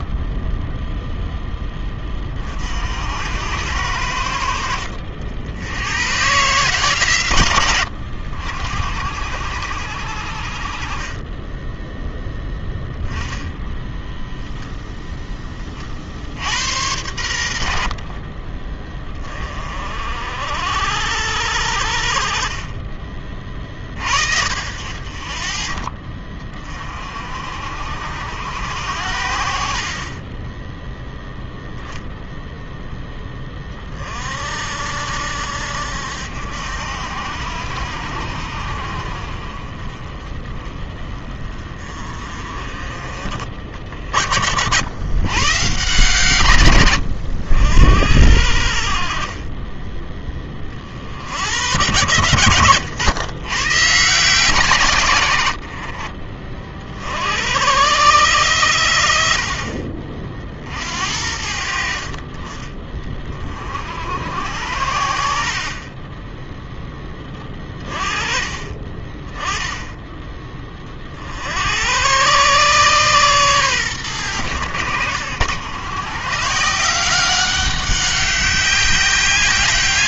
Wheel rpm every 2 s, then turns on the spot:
10, 60, 70, 140, 60, 40, 10, 0, 80, 30, 70, 30, 60, 40, 80, 10, 0, 70, 70, 50, 30, 30, 80, 120, 60, 40, 100, 150, 50, 100, 60, 20, 70, 10, 30, 30, 130, 90, 160, 190.
none